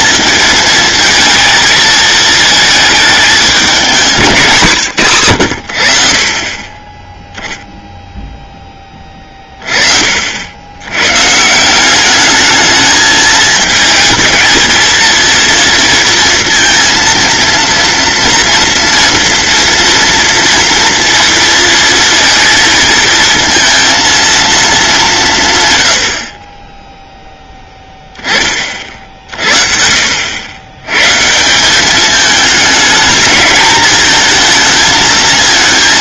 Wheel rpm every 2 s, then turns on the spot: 220, 220, 150, 20, 20, 110, 220, 220, 230, 240, 230, 230, 200, 10, 40, 110, 220, 230.
none